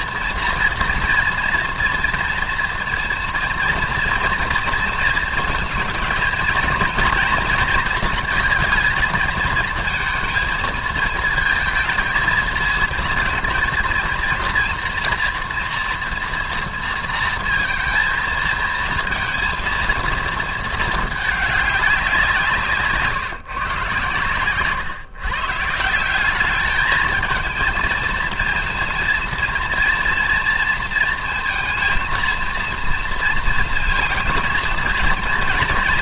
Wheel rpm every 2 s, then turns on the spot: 230, 230, 230, 230, 220, 230, 230, 240, 230, 230, 220, 150, 130, 220, 230, 230, 230, 230.
none